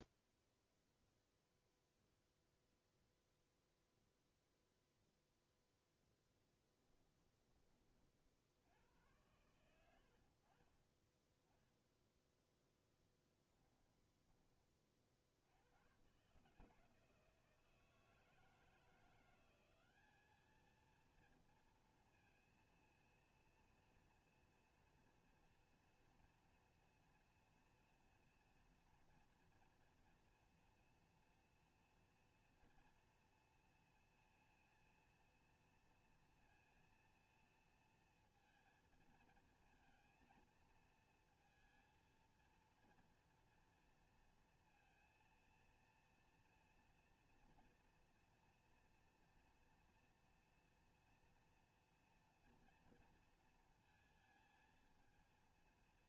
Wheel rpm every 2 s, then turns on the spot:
0, 0, 0, 10, 70, 40, 10, 20, 150, 160, 210, 230, 230, 230, 230, 230, 230, 230, 230, 230, 220, 220, 230, 230, 230, 230, 230, 220.
6-8 12-14